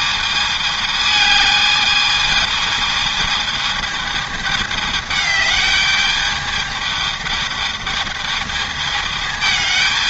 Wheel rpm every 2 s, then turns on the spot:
210, 220, 210, 210, 210.
none